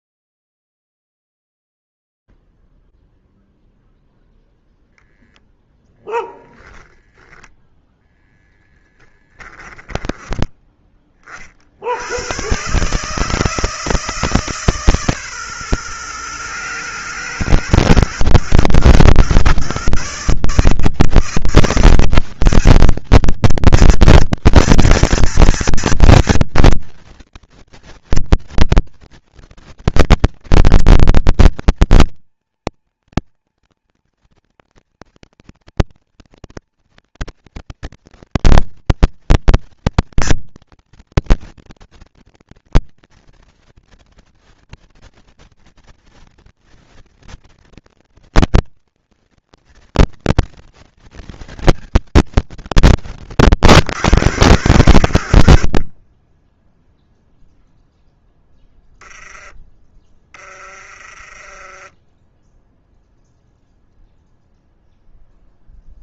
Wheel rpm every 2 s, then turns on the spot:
0, 0, 0, 0, 0, 10, 70, 160, 120, 110, 130, 190, 230, 240, 230, 230, 230, 240, 230, 230, 230, 230, 230, 230, 230, 230, 170, 120, 10, 10, 20, 0, 0.
10-12